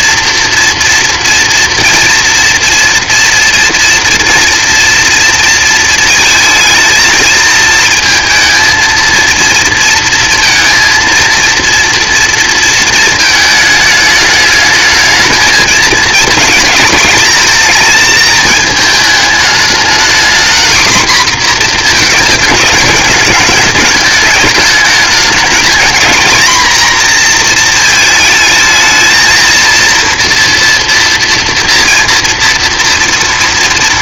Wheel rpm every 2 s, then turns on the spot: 230, 240, 230, 230, 230, 230, 220, 220, 210, 210, 240, 210, 220, 240, 220, 230, 220.
none